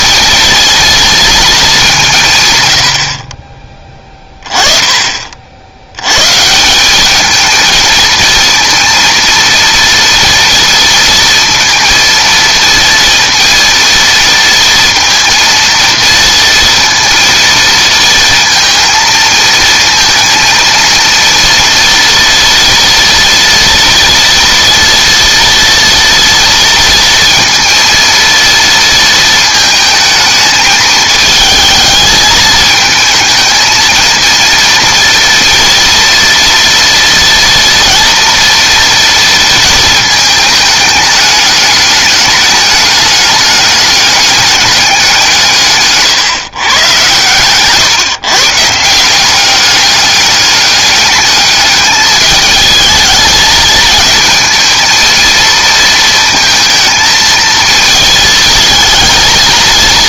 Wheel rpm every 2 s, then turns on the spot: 230, 110, 20, 180, 230, 230, 230, 230, 230, 230, 230, 230, 230, 230, 220, 220, 220, 230, 230, 230, 210, 210, 200, 130, 160, 210, 220, 220, 220, 220.
none